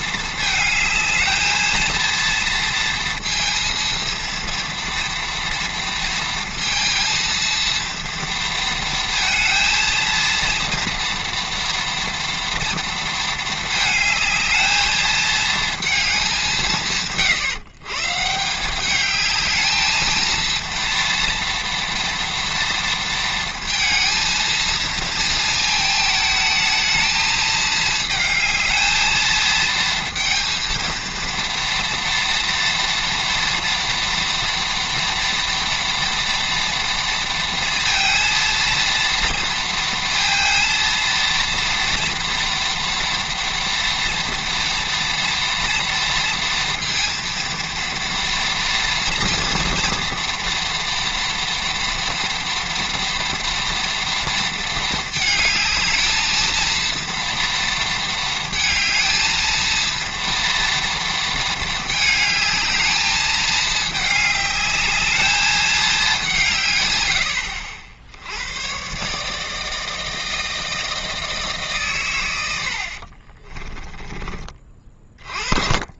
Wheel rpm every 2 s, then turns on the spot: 220, 230, 230, 230, 230, 230, 230, 220, 150, 200, 230, 230, 230, 220, 220, 230, 230, 230, 230, 230, 230, 240, 240, 230, 230, 230, 230, 220, 230, 220, 230, 210, 210, 120, 130, 160, 50, 30.
72-74